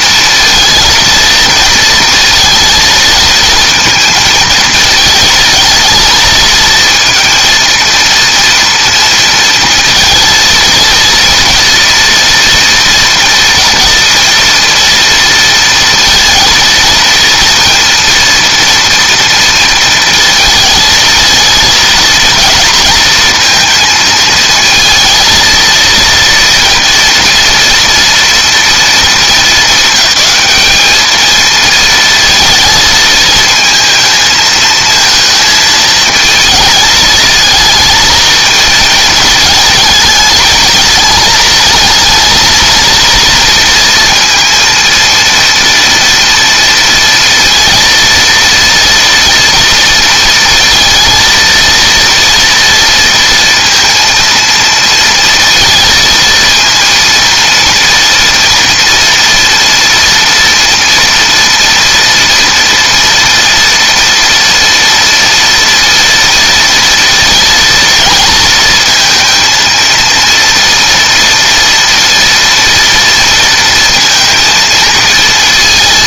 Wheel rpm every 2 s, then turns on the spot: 220, 220, 230, 220, 230, 230, 230, 230, 230, 230, 230, 230, 220, 230, 230, 210, 230, 220, 220, 220, 220, 220, 230, 230, 230, 230, 230, 230, 230, 230, 230, 230, 230, 230, 220, 230, 240, 230.
none